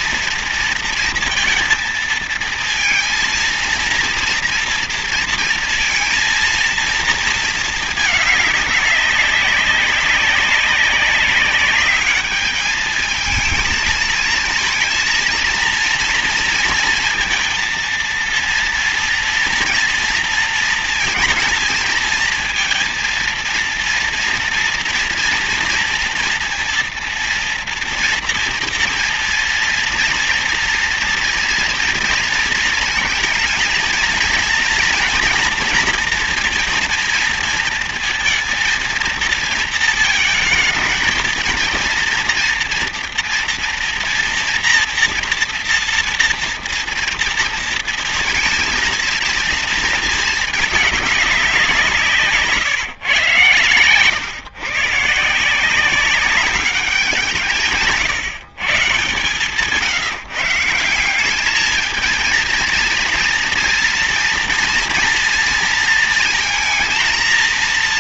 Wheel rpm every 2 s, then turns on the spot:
230, 230, 230, 230, 200, 190, 210, 230, 230, 230, 230, 230, 230, 230, 230, 230, 230, 240, 230, 230, 230, 240, 230, 240, 230, 210, 140, 140, 190, 140, 180, 230, 230, 230.
none